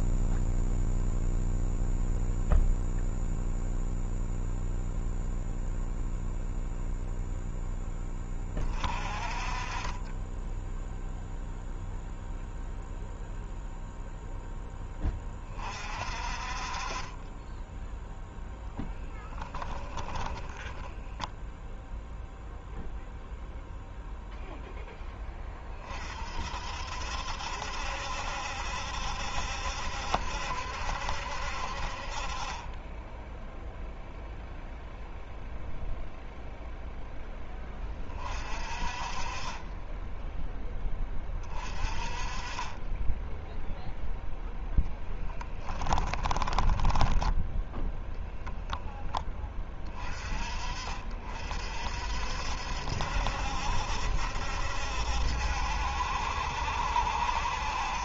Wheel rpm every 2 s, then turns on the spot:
0, 0, 0, 0, 30, 10, 0, 10, 30, 10, 0, 0, 10, 60, 70, 70, 20, 0, 0, 30, 20, 20, 10, 20, 0, 40, 70, 70, 70.
44-48